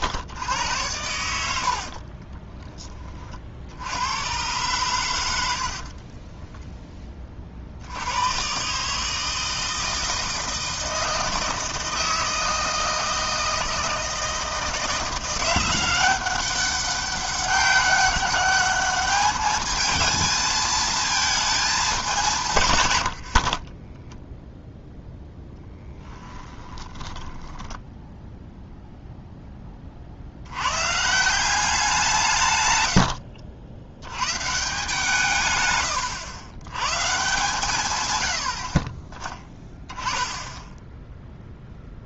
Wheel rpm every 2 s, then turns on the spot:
100, 20, 120, 10, 140, 160, 160, 170, 200, 210, 220, 120, 0, 20, 0, 120, 90, 160, 120, 30, 0.
22-24 26-28